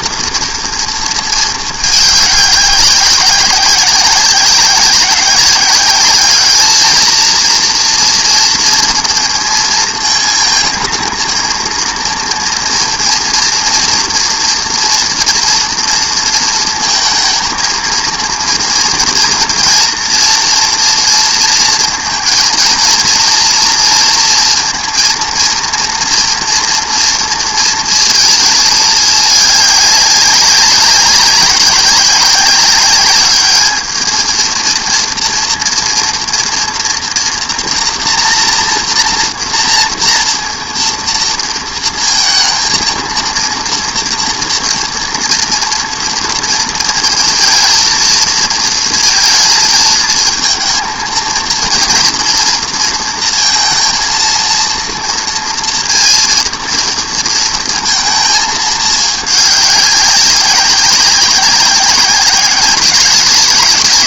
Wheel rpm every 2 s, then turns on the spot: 230, 200, 190, 220, 230, 220, 230, 240, 230, 230, 230, 220, 230, 230, 220, 190, 200, 230, 230, 230, 230, 230, 230, 230, 230, 230, 230, 230, 230, 220, 190, 190.
none